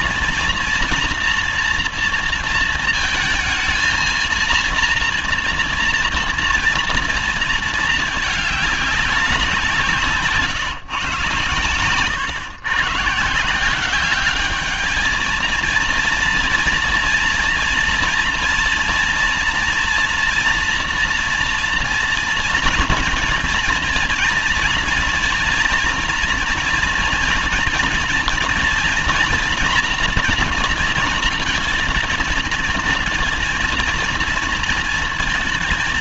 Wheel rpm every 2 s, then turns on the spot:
230, 230, 230, 230, 210, 130, 120, 210, 230, 230, 240, 230, 230, 240, 230, 230, 220, 230.
none